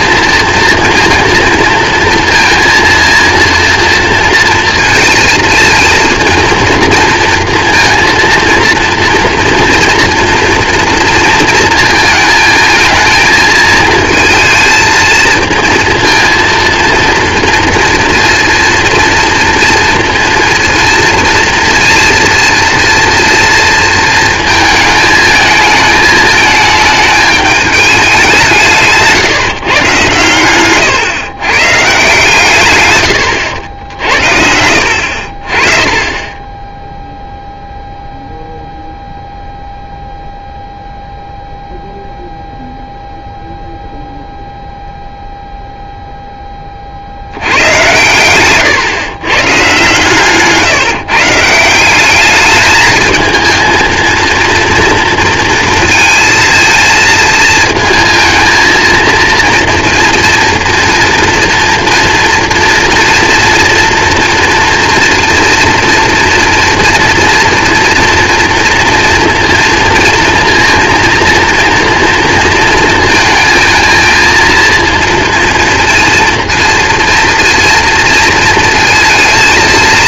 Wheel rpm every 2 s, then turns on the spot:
230, 230, 230, 230, 230, 230, 220, 230, 230, 240, 230, 230, 220, 220, 170, 130, 120, 70, 20, 0, 0, 0, 0, 20, 120, 150, 220, 230, 230, 230, 230, 230, 240, 240, 230, 230, 230, 230, 230, 230.
none